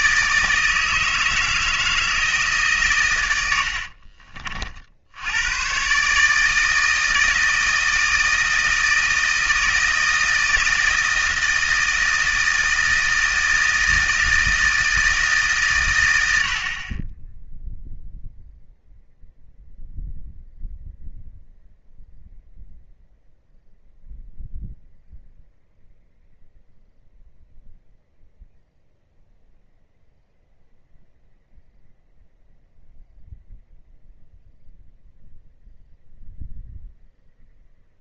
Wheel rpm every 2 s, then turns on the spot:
160, 140, 50, 160, 160, 160, 160, 160, 50, 0, 0, 0, 0, 0, 0, 0, 0, 0, 0.
none